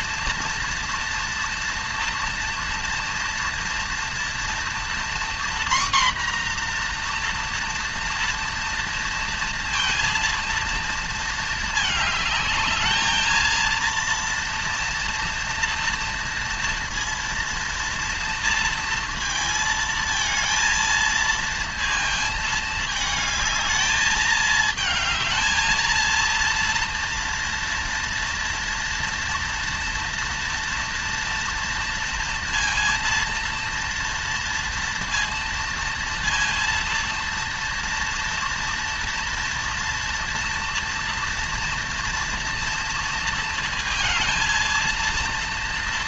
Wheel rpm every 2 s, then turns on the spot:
230, 230, 230, 250, 240, 230, 210, 230, 230, 230, 230, 220, 220, 230, 230, 230, 230, 230, 230, 230, 230, 230, 220.
none